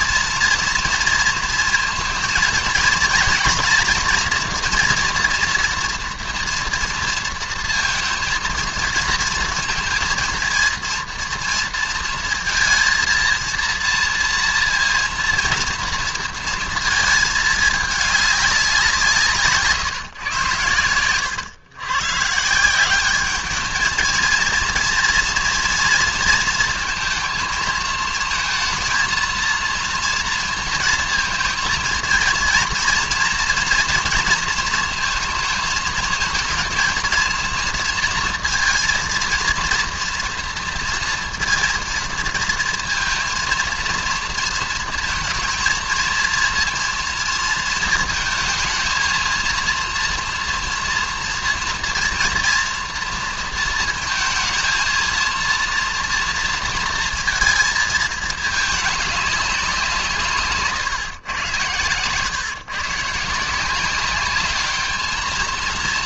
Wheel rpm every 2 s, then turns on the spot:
230, 230, 240, 230, 230, 230, 230, 230, 230, 190, 110, 170, 230, 230, 230, 230, 240, 230, 220, 230, 230, 230, 230, 230, 220, 230, 230, 220, 230, 210, 140, 140, 210.
60-62